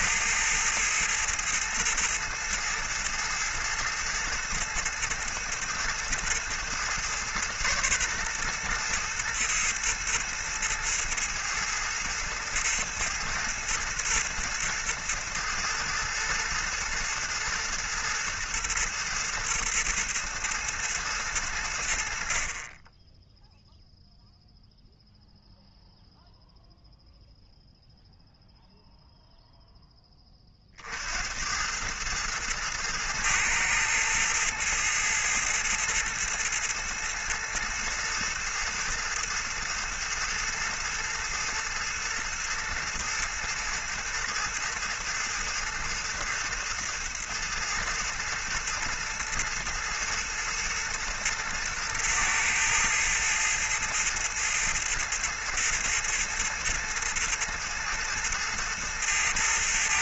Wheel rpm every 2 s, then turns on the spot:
110, 110, 120, 120, 120, 110, 110, 110, 110, 110, 110, 30, 0, 0, 0, 50, 110, 110, 110, 110, 110, 110, 110, 110, 110, 110, 110, 110, 110, 110.
none